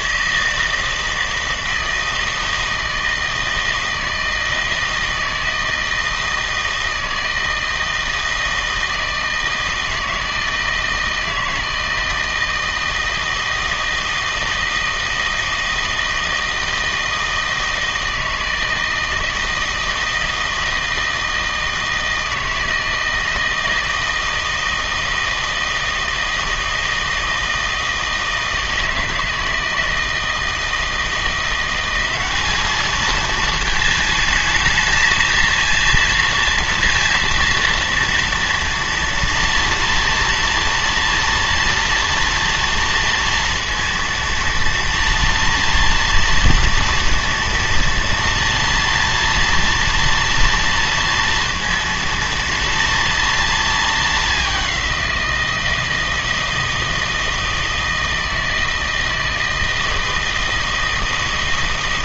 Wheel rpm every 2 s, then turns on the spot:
160, 160, 160, 160, 160, 160, 160, 160, 160, 160, 160, 160, 160, 160, 160, 160, 210, 220, 230, 230, 230, 230, 230, 230, 230, 230, 230, 200, 160, 160, 160.
none